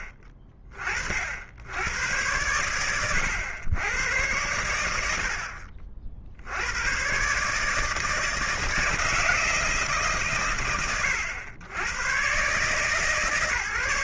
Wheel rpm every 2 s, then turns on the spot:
60, 100, 90, 90, 160, 120, 130.
none